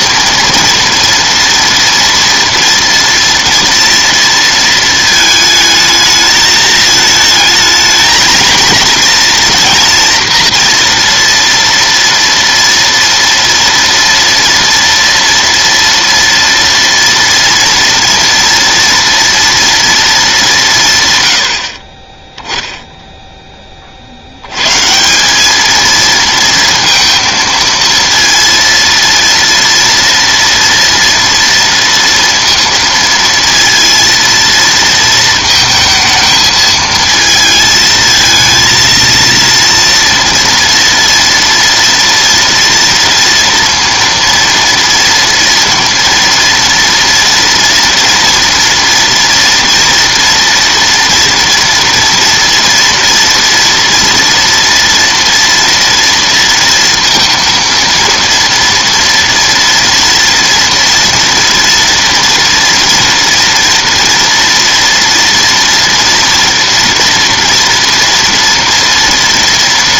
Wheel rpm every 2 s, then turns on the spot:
230, 230, 220, 220, 230, 230, 230, 230, 230, 230, 170, 0, 130, 230, 230, 230, 230, 230, 220, 230, 230, 230, 230, 230, 230, 230, 230, 230, 230, 230, 230, 230, 230, 230, 230.
none